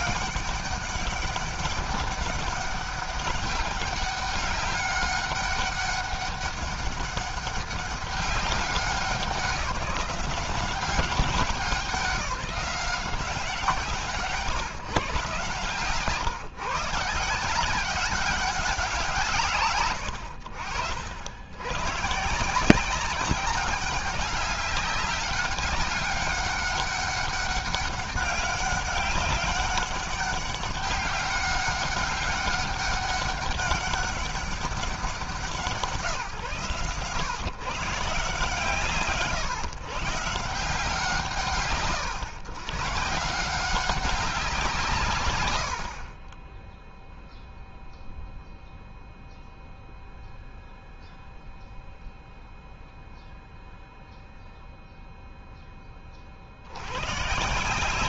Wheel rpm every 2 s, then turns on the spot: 200, 200, 200, 200, 190, 180, 190, 170, 150, 200, 90, 150, 200, 200, 200, 200, 200, 200, 140, 150, 160, 120, 190, 30, 0, 0, 0, 0, 60.
none